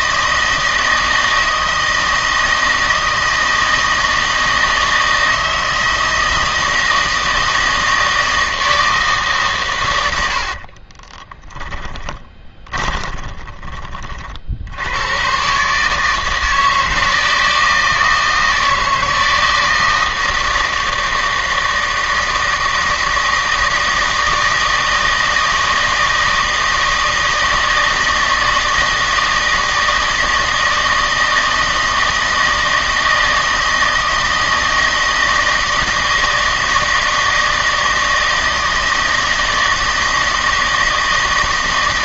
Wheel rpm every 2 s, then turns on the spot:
160, 160, 160, 160, 160, 40, 20, 80, 160, 160, 160, 160, 160, 160, 160, 160, 160, 160, 160, 160, 160.
10-14